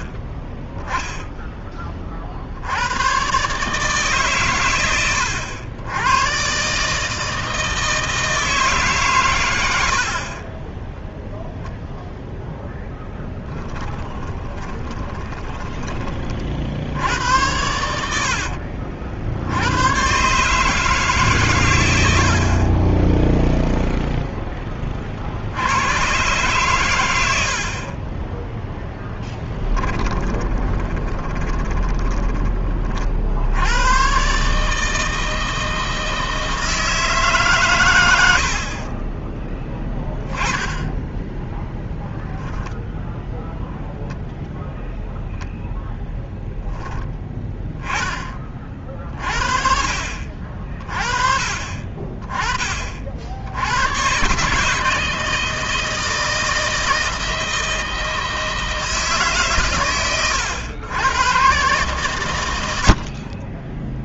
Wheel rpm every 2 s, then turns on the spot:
10, 100, 100, 140, 140, 10, 0, 20, 70, 60, 150, 20, 30, 110, 10, 20, 30, 160, 160, 40, 0, 0, 0, 10, 40, 40, 40, 150, 160, 160, 110, 70.
14-16 28-32 38-40